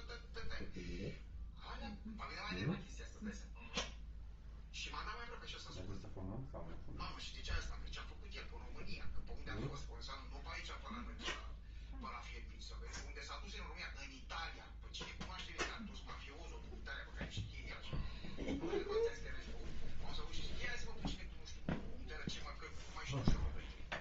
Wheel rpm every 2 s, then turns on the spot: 0, 0, 0, 0, 0, 0, 0, 0, 0, 0, 0, 0.
none